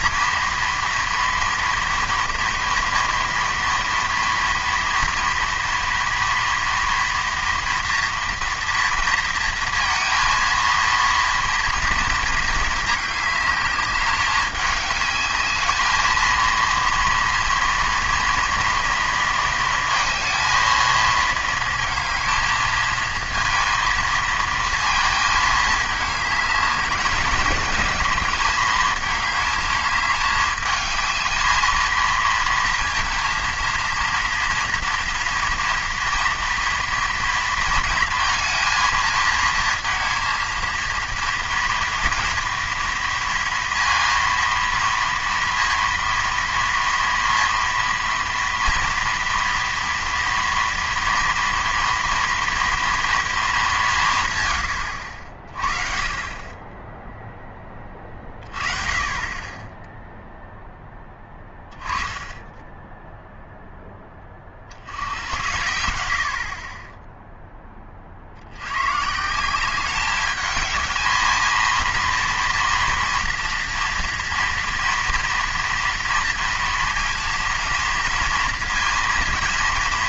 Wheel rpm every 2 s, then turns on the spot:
230, 230, 230, 230, 230, 230, 220, 210, 230, 230, 230, 220, 220, 210, 210, 210, 230, 230, 230, 230, 230, 230, 230, 230, 240, 230, 230, 110, 20, 30, 0, 10, 50, 40, 90, 210, 230, 230, 230, 230.
62-64